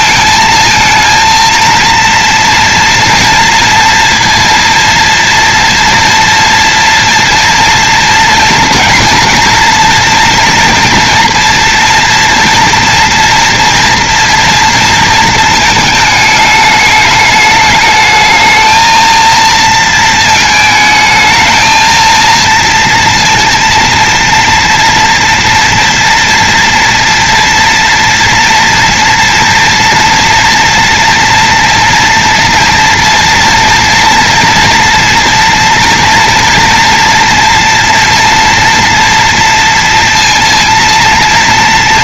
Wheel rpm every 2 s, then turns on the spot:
230, 240, 230, 240, 230, 230, 230, 230, 210, 220, 220, 230, 230, 240, 230, 230, 230, 230, 230, 230, 230.
none